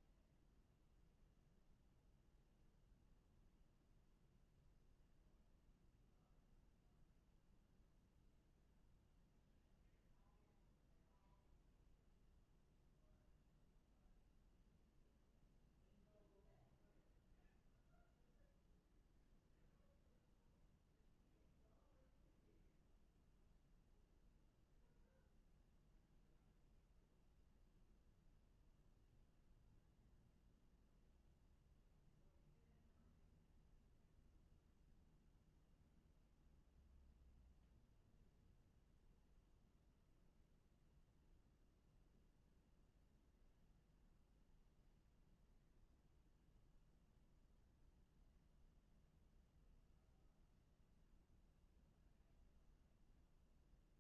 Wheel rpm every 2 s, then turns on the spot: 0, 0, 0, 0, 0, 0, 0, 0, 0, 0, 0, 0, 0, 0, 0, 0, 0, 0, 0, 0, 0, 0, 0, 0, 0, 0, 0.
none